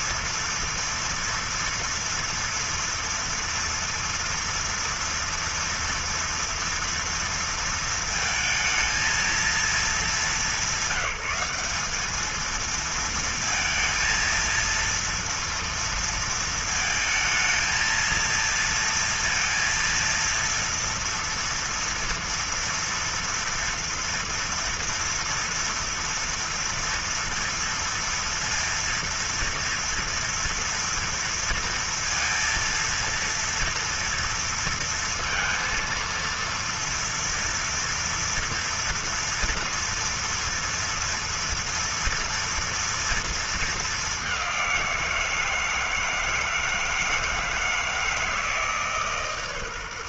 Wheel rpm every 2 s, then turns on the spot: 230, 230, 230, 230, 220, 210, 220, 230, 230, 230, 230, 230, 230, 230, 230, 230, 230, 230, 230, 230, 230, 240, 200, 160, 160.
none